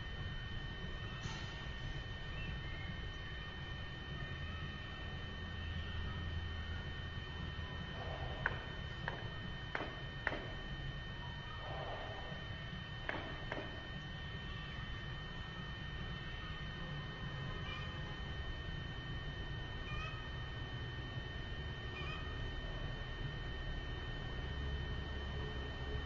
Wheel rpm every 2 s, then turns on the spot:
0, 0, 0, 0, 0, 0, 0, 0, 0, 0, 0, 0, 0.
none